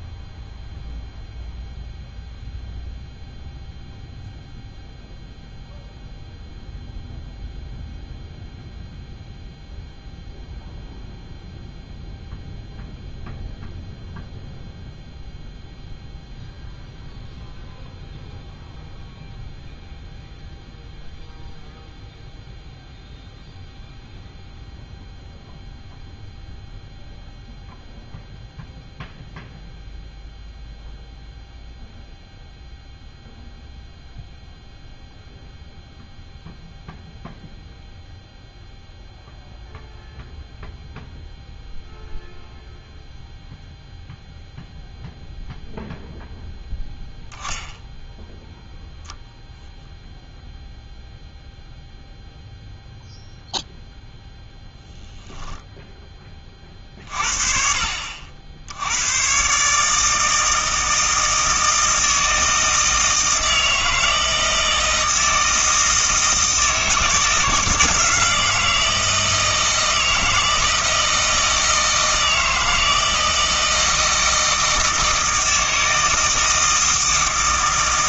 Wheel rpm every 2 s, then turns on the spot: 0, 0, 0, 0, 0, 0, 0, 0, 0, 0, 0, 0, 0, 0, 0, 0, 0, 0, 0, 0, 0, 0, 0, 0, 0, 0, 0, 0, 30, 70, 160, 160, 160, 160, 160, 160, 160, 160, 160.
none